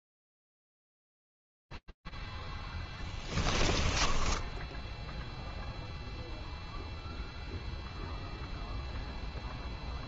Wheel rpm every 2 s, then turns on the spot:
0, 0, 10, 0, 0.
4-6